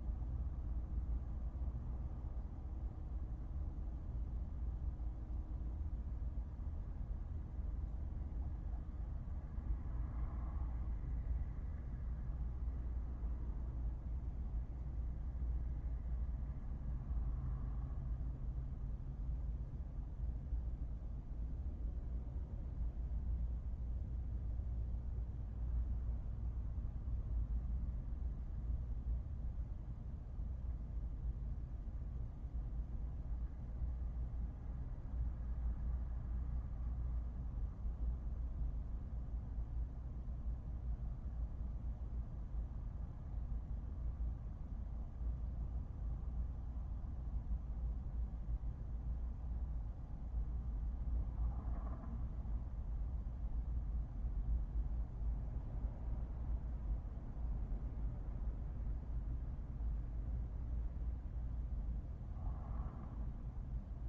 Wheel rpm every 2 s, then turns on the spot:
0, 0, 0, 0, 0, 0, 0, 0, 0, 0, 0, 0, 0, 0, 0, 0, 0, 0, 0, 0, 0, 0, 0, 0, 0, 0, 0, 0, 0, 0, 0, 0.
none